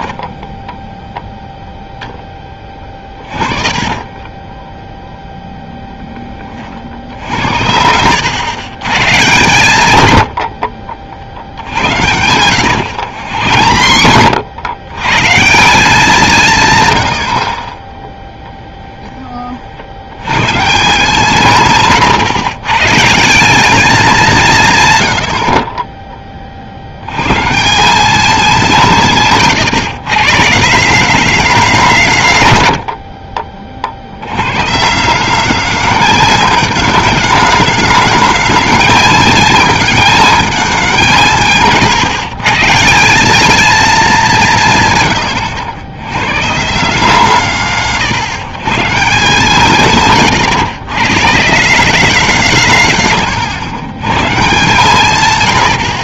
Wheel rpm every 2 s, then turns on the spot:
10, 20, 20, 50, 120, 70, 100, 100, 150, 10, 130, 130, 170, 40, 180, 160, 130, 120, 210, 210, 210, 160, 160, 150, 130, 130, 160, 140.
0-6 12-14 18-20